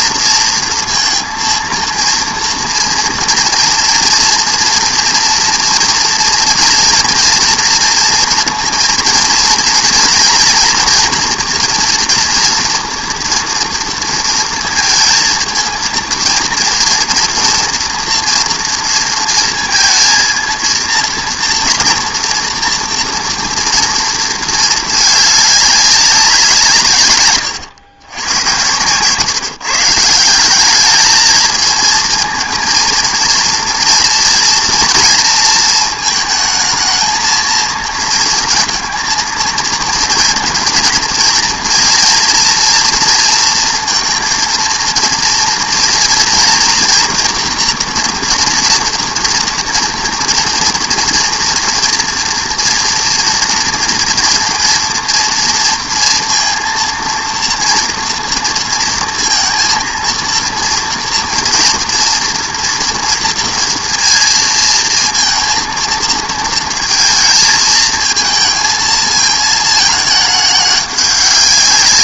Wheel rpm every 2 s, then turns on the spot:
230, 230, 230, 230, 230, 230, 240, 230, 230, 230, 230, 230, 220, 160, 110, 190, 230, 230, 220, 230, 230, 230, 230, 230, 230, 240, 240, 230, 230, 230, 230, 230, 230, 230, 230, 210.
none